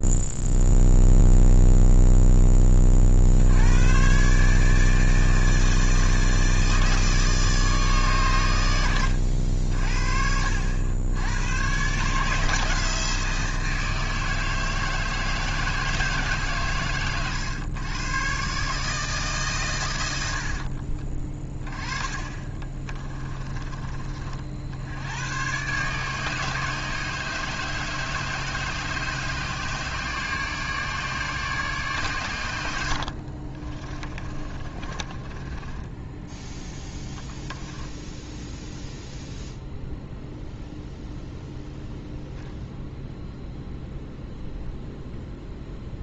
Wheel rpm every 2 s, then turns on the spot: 0, 30, 150, 160, 100, 70, 160, 160, 120, 150, 60, 30, 70, 150, 150, 150, 80, 30, 0, 0, 0, 0, 0.
20-24 32-36